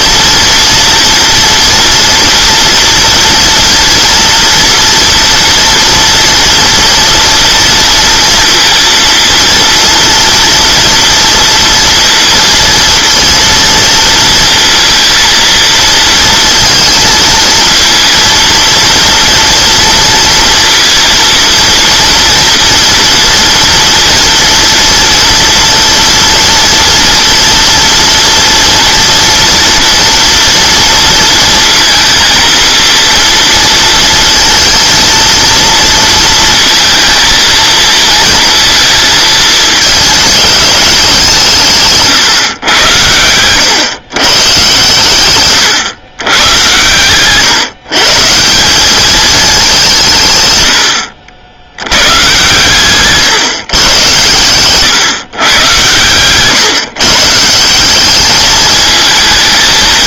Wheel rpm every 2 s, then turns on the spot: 230, 240, 230, 230, 230, 230, 230, 230, 230, 230, 230, 230, 230, 230, 230, 230, 230, 230, 230, 230, 200, 120, 120, 120, 180, 100, 130, 110, 130, 220.
54-56